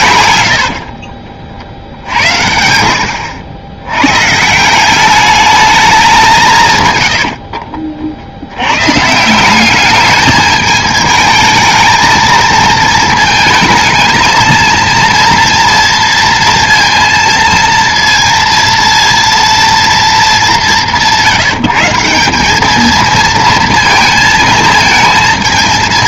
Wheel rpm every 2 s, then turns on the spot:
70, 80, 160, 140, 100, 210, 220, 230, 230, 230, 190, 210, 220.
0-2